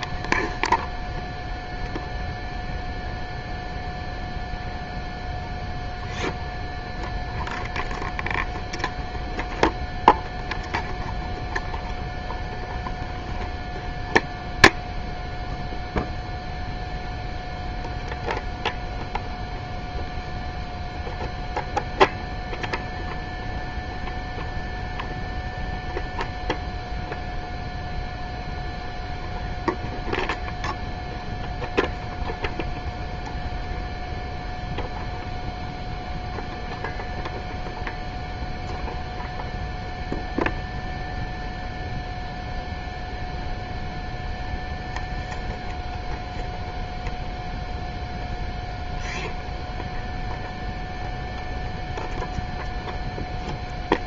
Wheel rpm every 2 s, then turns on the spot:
0, 0, 0, 0, 0, 0, 0, 0, 0, 0, 0, 0, 0, 0, 0, 0, 0, 0, 0, 0, 0, 0, 0, 0, 0, 0, 0.
none